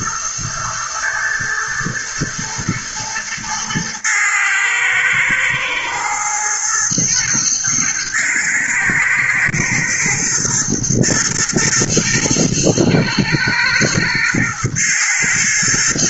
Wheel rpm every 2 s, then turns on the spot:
120, 120, 110, 120, 110, 110, 110, 110.
none